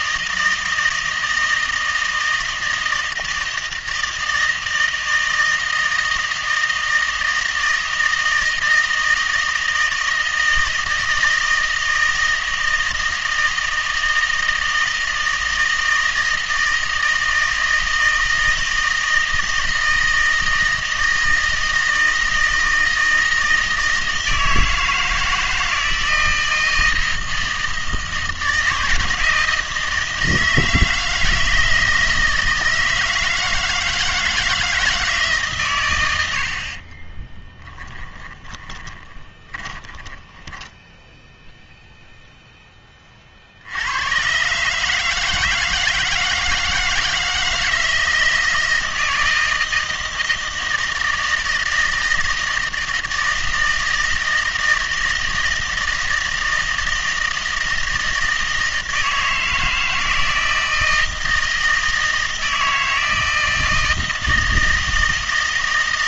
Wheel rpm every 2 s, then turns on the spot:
160, 160, 160, 160, 160, 160, 160, 160, 160, 160, 160, 160, 160, 160, 160, 160, 160, 160, 50, 20, 10, 10, 150, 160, 170, 160, 160, 160, 160, 160, 160, 160, 160.
36-42